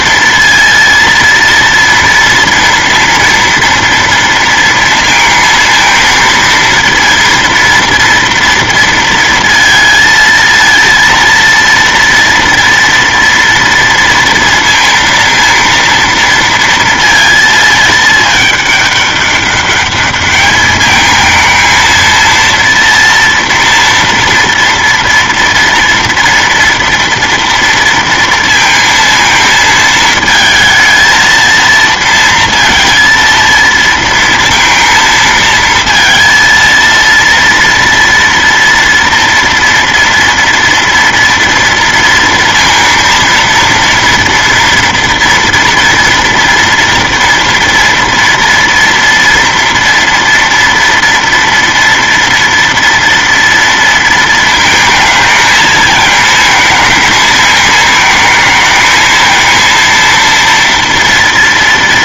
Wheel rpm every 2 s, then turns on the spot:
230, 230, 230, 230, 230, 230, 230, 230, 230, 210, 210, 230, 230, 230, 230, 220, 230, 230, 230, 230, 230, 230, 230, 230, 230, 230, 230, 230, 220, 220, 230.
none